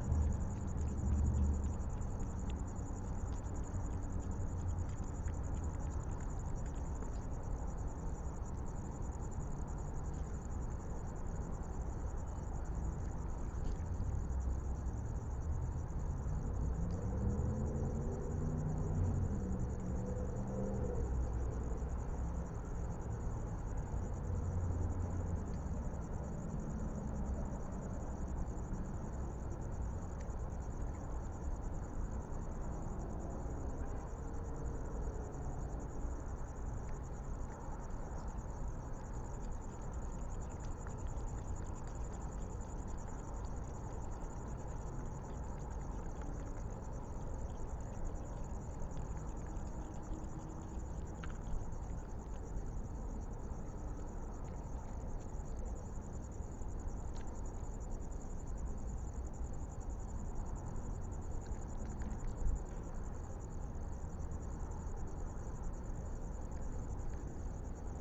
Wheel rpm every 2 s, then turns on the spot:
0, 0, 0, 0, 0, 0, 0, 0, 0, 0, 0, 0, 0, 0, 0, 0, 0, 0, 0, 0, 0, 0, 0, 0, 0, 0, 0, 0, 0, 0, 0, 0, 0, 0.
none